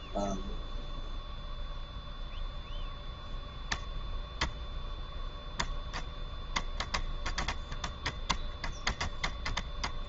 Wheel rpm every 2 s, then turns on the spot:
0, 0, 0, 20, 0.
none